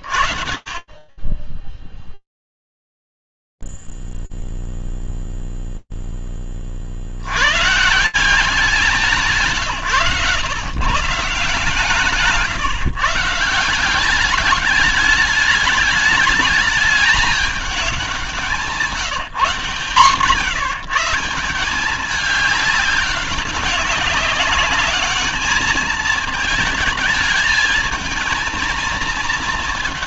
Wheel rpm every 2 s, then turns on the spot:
40, 0, 0, 20, 170, 130, 150, 200, 210, 180, 140, 200, 210, 220, 220.
none